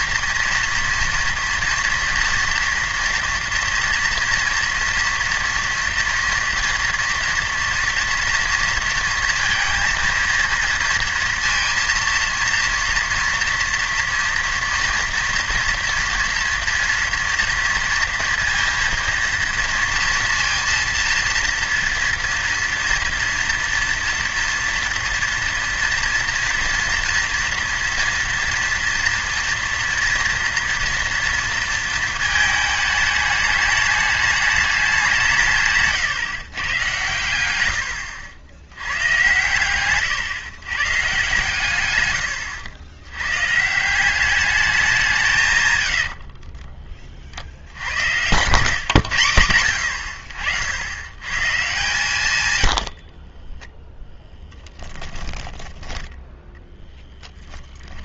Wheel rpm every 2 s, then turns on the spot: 230, 230, 240, 240, 230, 230, 230, 230, 230, 230, 230, 230, 230, 240, 230, 230, 220, 210, 120, 100, 140, 90, 200, 30, 120, 80, 100, 10, 10.
46-48